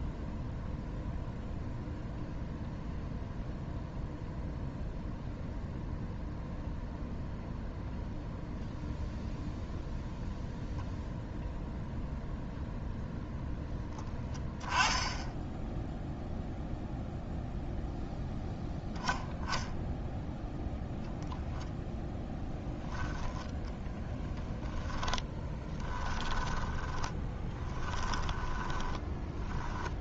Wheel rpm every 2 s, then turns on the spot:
0, 0, 0, 0, 0, 0, 0, 10, 0, 0, 0, 10, 10, 10, 10.
24-30